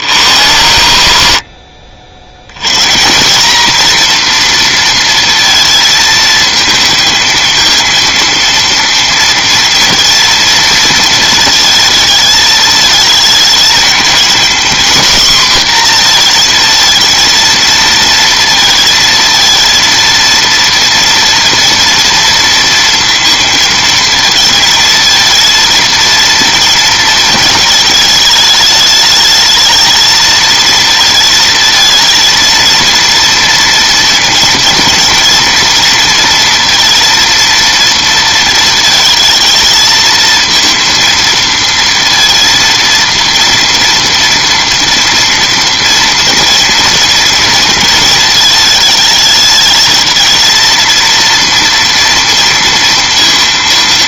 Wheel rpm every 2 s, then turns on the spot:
70, 150, 230, 220, 230, 230, 220, 240, 230, 230, 230, 230, 230, 230, 210, 220, 230, 240, 230, 230, 230, 230, 230, 230, 220, 220, 230.
none